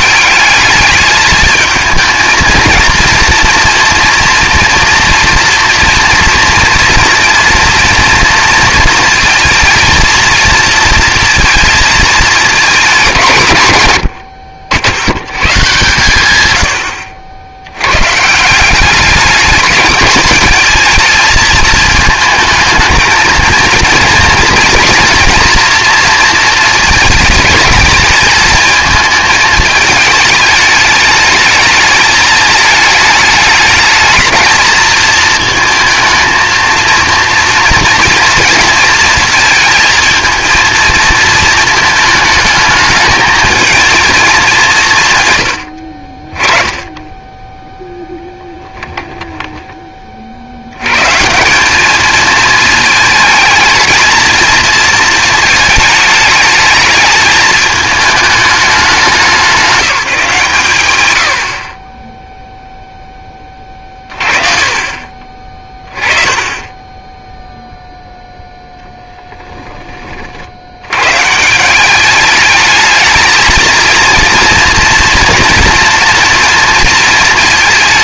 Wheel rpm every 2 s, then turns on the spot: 200, 230, 230, 230, 230, 230, 220, 90, 100, 170, 220, 220, 240, 230, 220, 210, 220, 220, 220, 230, 220, 220, 190, 20, 10, 70, 220, 230, 210, 210, 150, 0, 40, 40, 0, 70, 210, 230, 240.
48-50